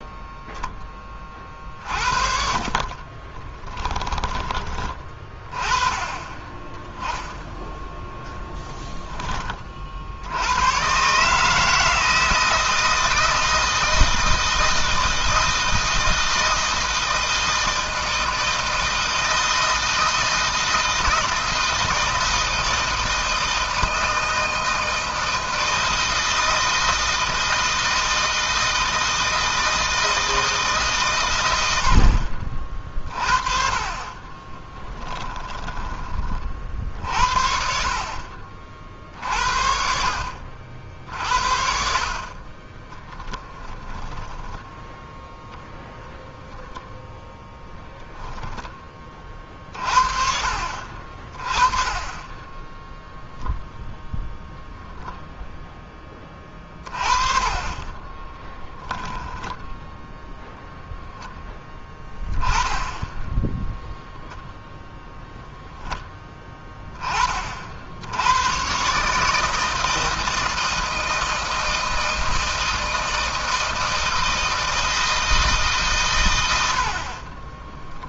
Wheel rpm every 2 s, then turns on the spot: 10, 30, 20, 10, 10, 120, 160, 160, 160, 160, 160, 160, 160, 160, 160, 140, 50, 20, 40, 50, 60, 20, 0, 0, 30, 30, 10, 0, 30, 10, 0, 10, 0, 20, 120, 160, 160, 160, 70.
2-4 8-10 34-36 42-44